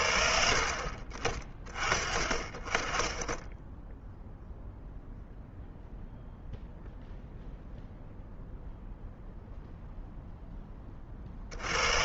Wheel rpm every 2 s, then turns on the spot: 50, 20, 0, 0, 0, 10.
none